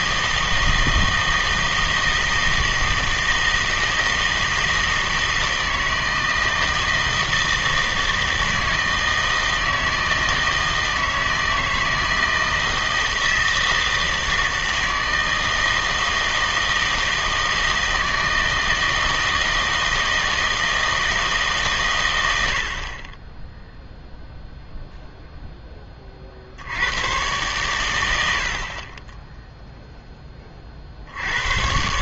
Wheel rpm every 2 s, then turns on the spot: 160, 160, 160, 160, 160, 160, 160, 160, 160, 160, 160, 60, 0, 80, 50, 50.
none